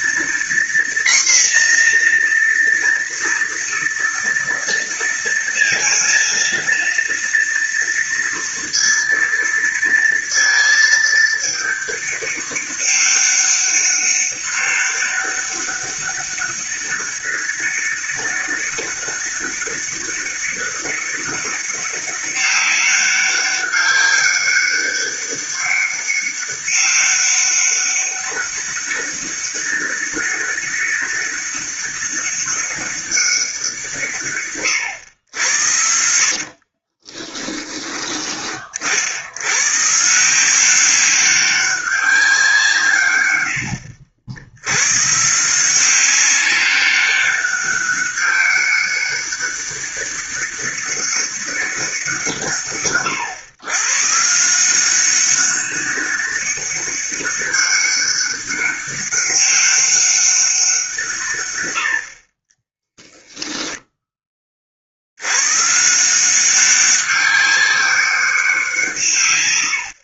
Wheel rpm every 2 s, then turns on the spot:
240, 240, 230, 230, 230, 220, 200, 200, 200, 200, 200, 200, 200, 200, 200, 200, 200, 120, 40, 50, 190, 150, 100, 200, 200, 200, 140, 180, 200, 200, 170, 20, 50, 190, 170.
36-38 62-64